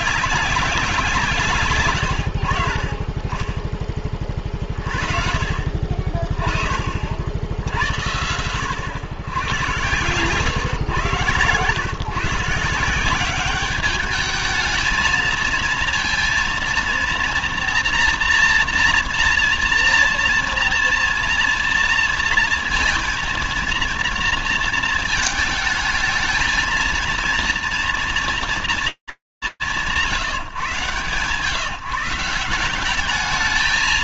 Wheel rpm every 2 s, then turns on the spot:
190, 80, 30, 40, 100, 120, 150, 210, 230, 240, 230, 230, 230, 220, 190, 130, 180.
none